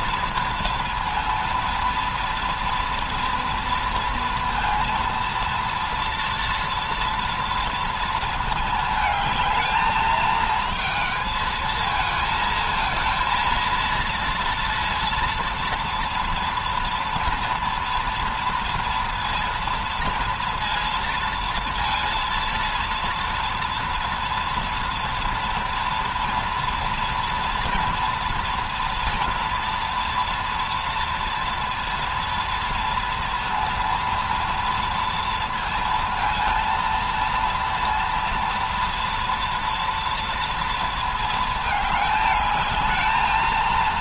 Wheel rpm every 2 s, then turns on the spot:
230, 230, 230, 230, 220, 220, 220, 230, 230, 230, 230, 230, 230, 230, 230, 230, 230, 230, 230, 230, 230, 210.
none